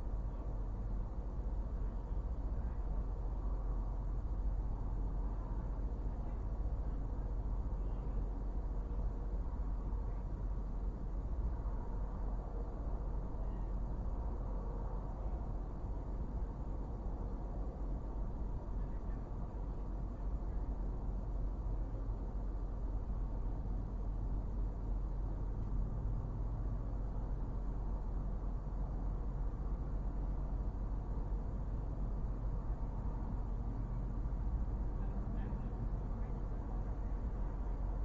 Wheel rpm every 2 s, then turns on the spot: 0, 0, 0, 0, 0, 0, 0, 0, 0, 0, 0, 0, 0, 0, 0, 0, 0, 0, 0.
none